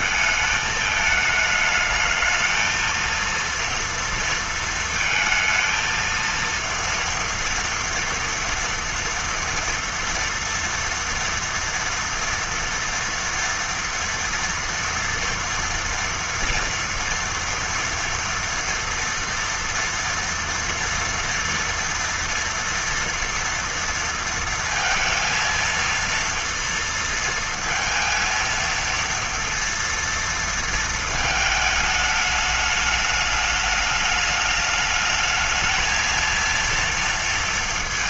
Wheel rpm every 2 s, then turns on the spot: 220, 230, 230, 230, 240, 230, 230, 230, 230, 230, 230, 230, 230, 230, 230, 230, 210, 210, 230.
none